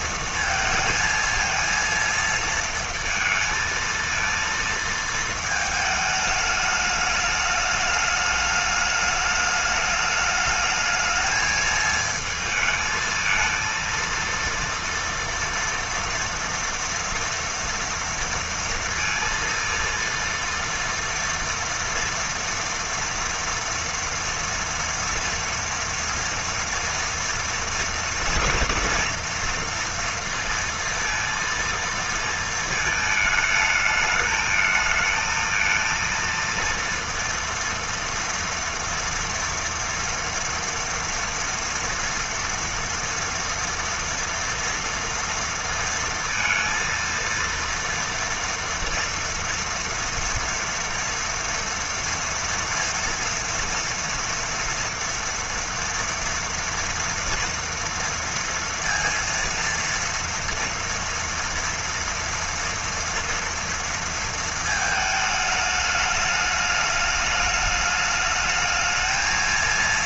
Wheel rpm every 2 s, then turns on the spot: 220, 230, 230, 210, 210, 220, 220, 230, 230, 230, 230, 240, 230, 230, 230, 230, 220, 220, 230, 230, 230, 230, 230, 230, 230, 240, 230, 230, 230, 230, 240, 230, 220, 210, 220.
none